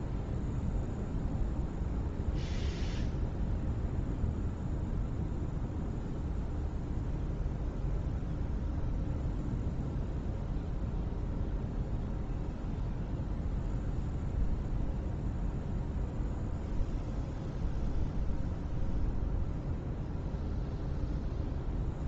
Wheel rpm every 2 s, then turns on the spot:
0, 0, 0, 0, 0, 0, 0, 0, 0, 0, 0.
none